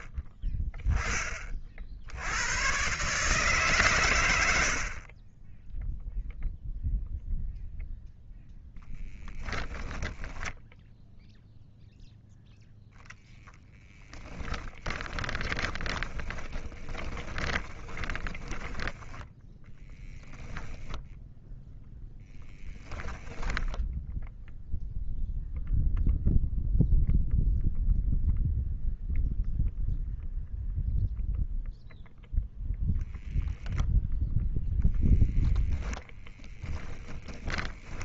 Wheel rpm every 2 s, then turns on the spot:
10, 130, 60, 0, 10, 0, 0, 10, 20, 10, 0, 10, 0, 0, 0, 0, 0, 0, 0.
4-6 8-10 14-20